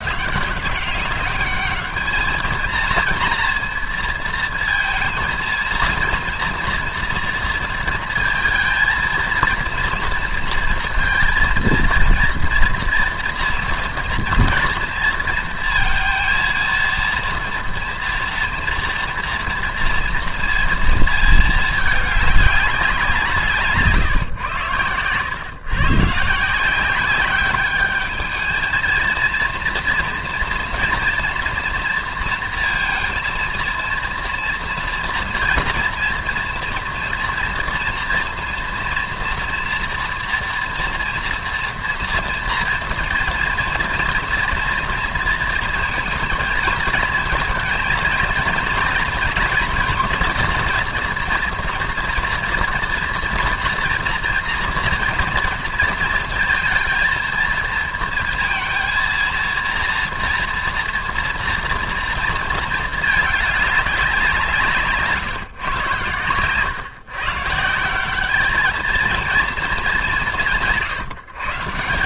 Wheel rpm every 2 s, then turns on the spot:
190, 230, 230, 230, 230, 230, 230, 230, 230, 230, 220, 180, 110, 180, 230, 230, 230, 230, 230, 240, 230, 230, 230, 220, 230, 230, 230, 230, 230, 230, 230, 220, 150, 140, 220, 150.
none